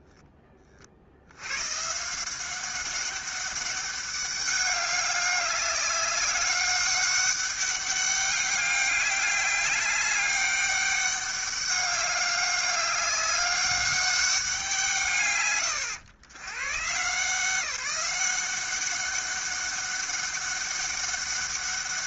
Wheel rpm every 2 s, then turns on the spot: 30, 190, 200, 200, 200, 200, 200, 150, 130, 190, 200.
none